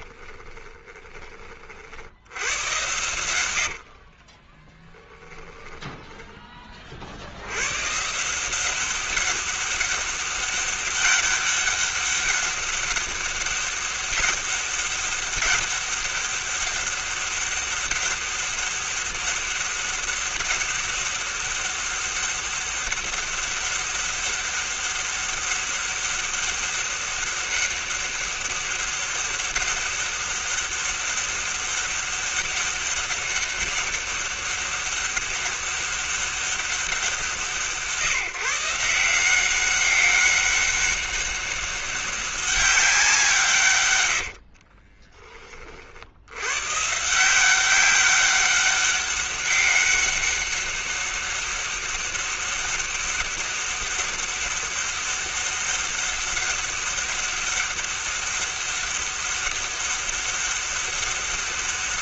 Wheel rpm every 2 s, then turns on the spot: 20, 80, 50, 10, 150, 200, 200, 200, 200, 200, 200, 200, 200, 200, 200, 200, 200, 200, 200, 160, 200, 200, 100, 80, 190, 200, 200, 200, 200, 200, 200.
0-2 4-8 44-46